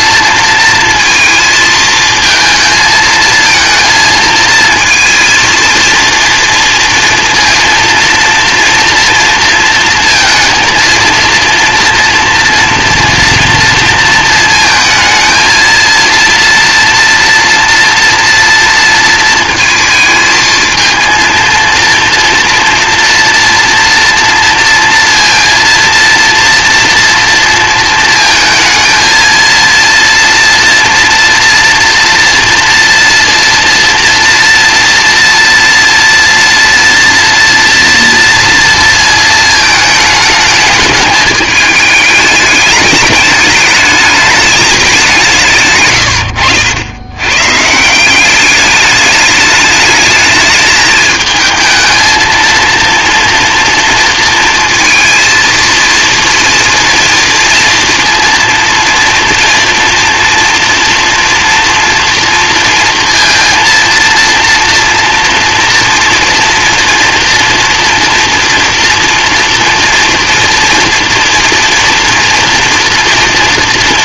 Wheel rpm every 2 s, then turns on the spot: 230, 220, 230, 230, 240, 230, 230, 230, 230, 230, 230, 230, 230, 230, 230, 230, 230, 240, 230, 230, 210, 210, 200, 90, 200, 210, 230, 230, 230, 230, 230, 230, 230, 230, 240, 230, 230.
none